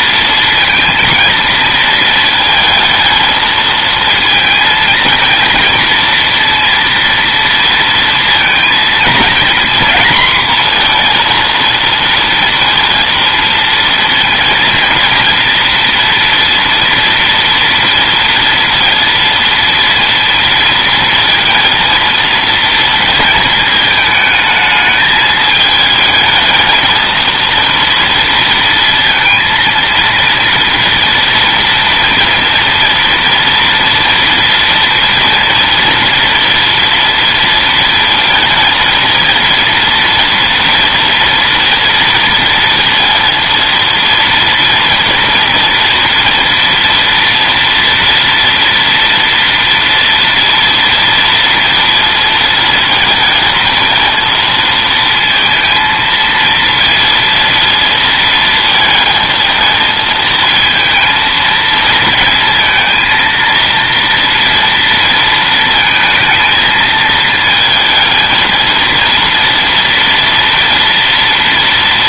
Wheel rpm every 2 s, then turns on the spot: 230, 220, 230, 230, 230, 240, 230, 230, 230, 230, 230, 230, 220, 220, 230, 230, 230, 230, 230, 230, 240, 230, 230, 230, 230, 230, 230, 230, 230, 220, 230, 230, 230, 220, 230, 230.
none